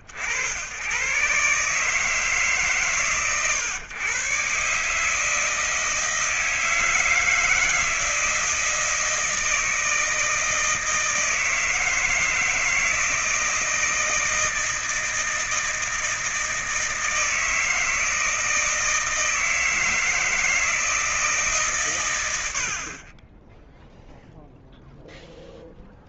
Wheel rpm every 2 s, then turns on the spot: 60, 140, 130, 160, 160, 160, 160, 160, 160, 160, 160, 140, 0.
none